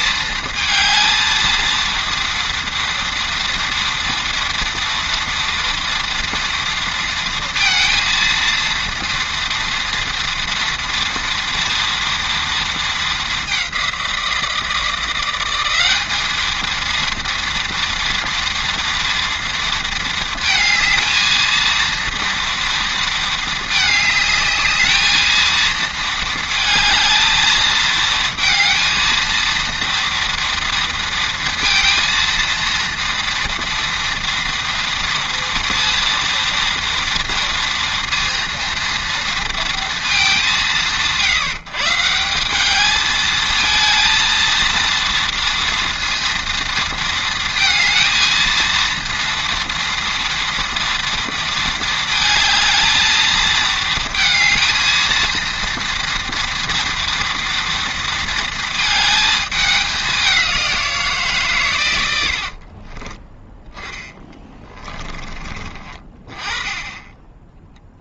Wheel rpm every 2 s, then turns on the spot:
220, 230, 230, 230, 230, 230, 210, 180, 230, 230, 220, 220, 220, 220, 230, 230, 230, 230, 230, 230, 160, 220, 230, 230, 230, 230, 220, 230, 230, 220, 160, 20, 30, 20.
62-66